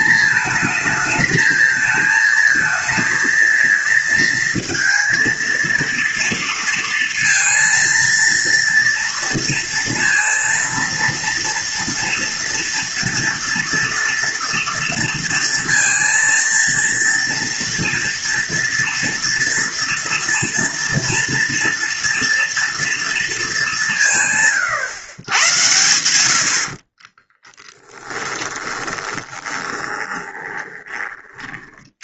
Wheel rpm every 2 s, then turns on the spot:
220, 230, 230, 230, 230, 230, 230, 230, 230, 240, 230, 230, 120, 50, 20, 20.
26-30